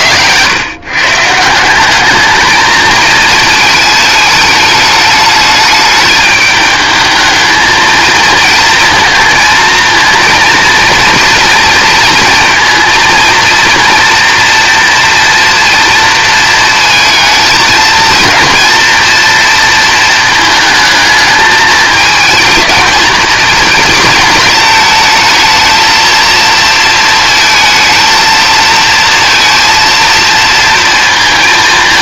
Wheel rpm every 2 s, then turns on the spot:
140, 220, 210, 220, 220, 230, 230, 230, 230, 230, 220, 220, 220, 220, 230, 230.
none